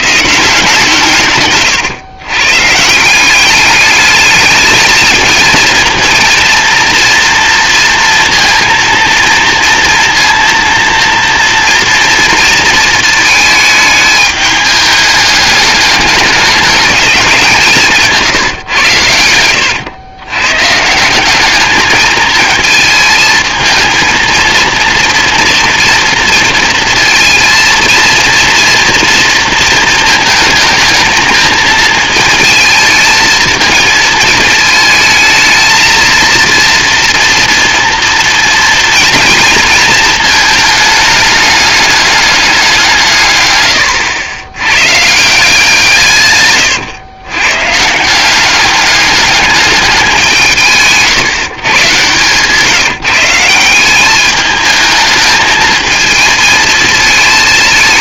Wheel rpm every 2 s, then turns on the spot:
160, 140, 210, 230, 230, 230, 220, 210, 210, 120, 140, 230, 230, 230, 230, 220, 220, 220, 230, 230, 220, 190, 100, 120, 190, 160, 150, 210, 220.
none